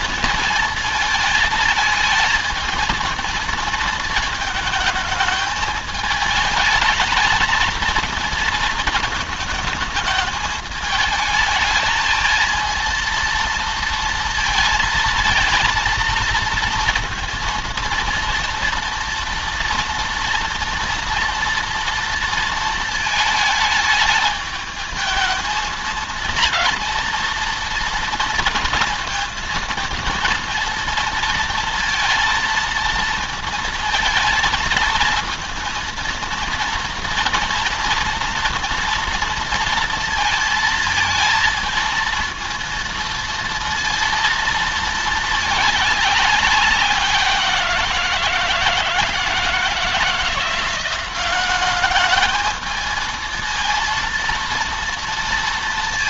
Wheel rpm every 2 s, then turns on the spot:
220, 230, 220, 220, 220, 220, 230, 230, 230, 230, 230, 220, 220, 230, 230, 230, 230, 230, 230, 230, 220, 230, 220, 190, 160, 180, 220, 230.
none